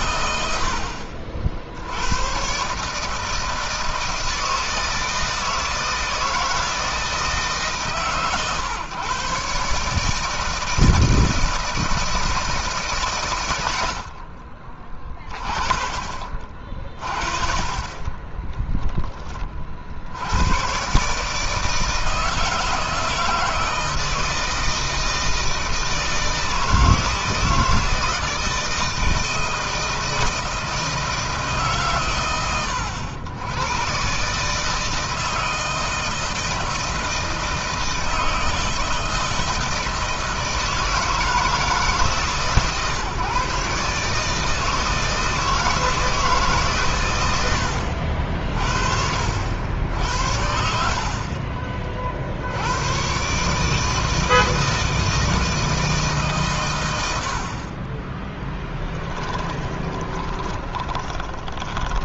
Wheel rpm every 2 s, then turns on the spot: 70, 140, 160, 160, 130, 160, 140, 30, 40, 10, 130, 160, 160, 160, 160, 160, 100, 160, 160, 160, 160, 140, 160, 120, 70, 60, 110, 160, 100, 10, 20.
58-62